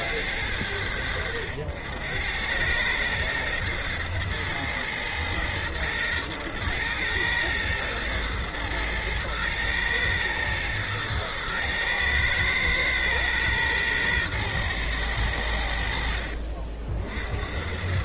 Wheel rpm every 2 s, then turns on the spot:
90, 90, 110, 110, 110, 110, 110, 120, 60.
none